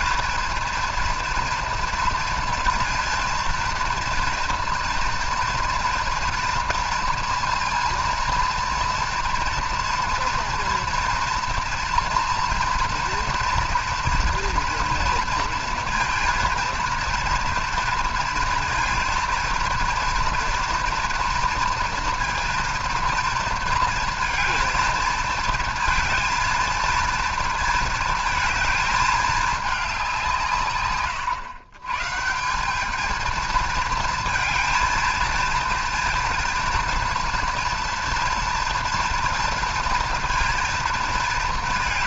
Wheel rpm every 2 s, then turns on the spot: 230, 230, 230, 230, 230, 230, 230, 230, 230, 230, 230, 230, 230, 230, 220, 130, 200, 230, 230, 240, 230.
none